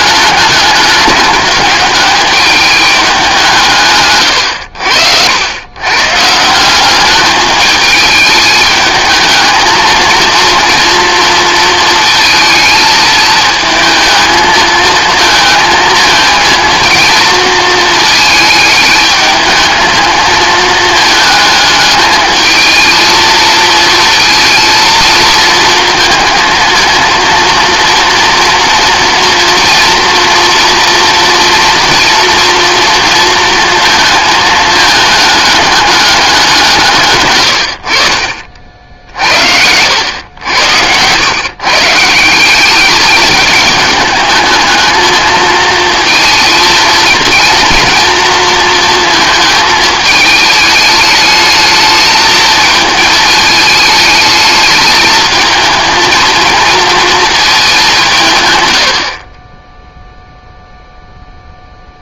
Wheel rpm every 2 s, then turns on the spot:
210, 210, 90, 170, 210, 230, 220, 220, 230, 220, 220, 220, 230, 220, 230, 230, 230, 220, 170, 50, 100, 190, 220, 230, 230, 210, 220, 210, 220, 110, 0.
38-40